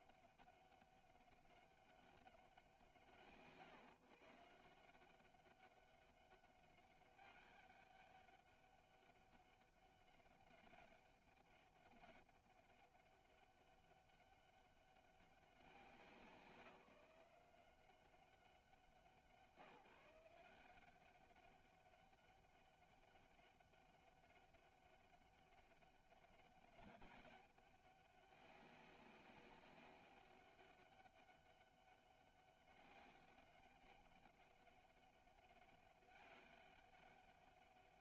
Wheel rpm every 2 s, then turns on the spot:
200, 160, 160, 200, 200, 200, 200, 200, 180, 170, 180, 200, 200, 200, 200, 200, 200, 200, 200.
none